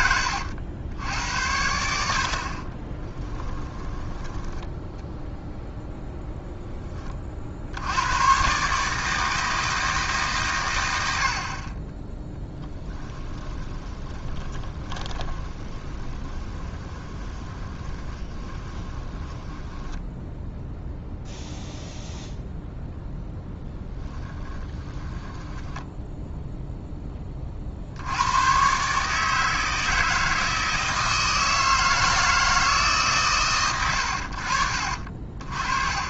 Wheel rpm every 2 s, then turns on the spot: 80, 30, 10, 20, 150, 90, 10, 20, 20, 20, 0, 0, 10, 10, 140, 160, 150, 40.
2-4 12-20 24-26